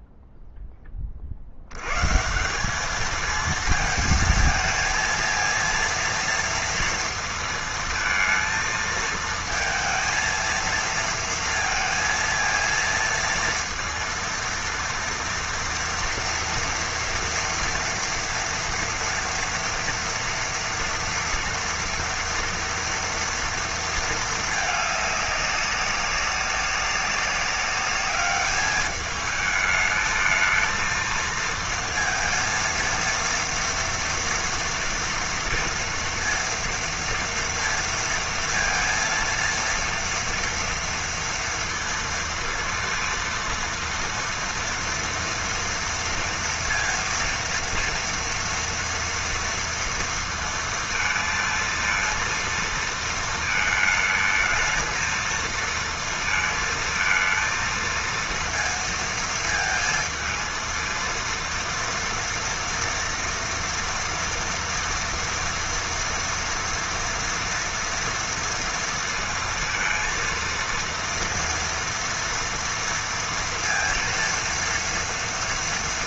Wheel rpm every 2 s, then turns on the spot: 0, 160, 230, 230, 220, 230, 230, 230, 230, 230, 230, 230, 220, 200, 210, 220, 230, 230, 230, 230, 230, 230, 230, 230, 230, 230, 230, 220, 230, 230, 220, 230, 230, 230, 230, 230, 230, 230.
none